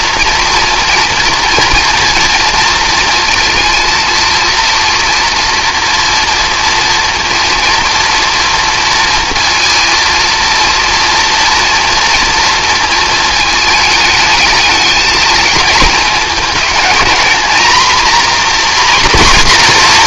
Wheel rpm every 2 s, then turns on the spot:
230, 230, 230, 240, 230, 230, 230, 220, 220, 250.
none